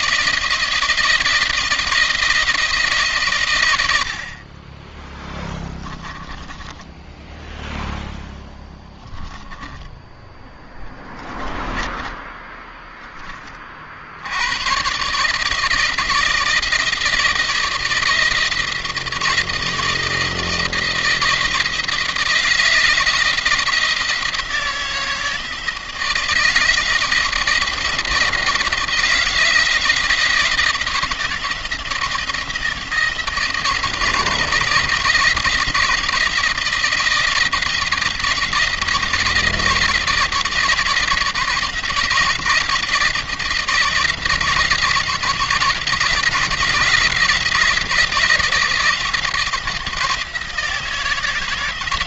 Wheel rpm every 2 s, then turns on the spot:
170, 160, 20, 10, 0, 10, 10, 110, 170, 170, 160, 160, 160, 170, 160, 170, 170, 160, 160, 170, 170, 170, 160, 160, 170, 160.
4-8 10-12